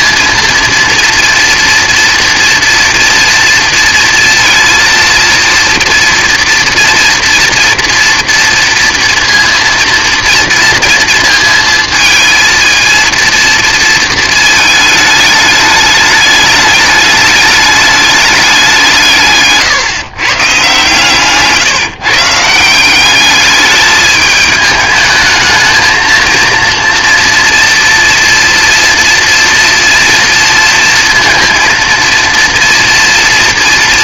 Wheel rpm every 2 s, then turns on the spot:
230, 230, 230, 230, 230, 230, 230, 220, 210, 180, 130, 170, 210, 230, 230, 230, 230.
none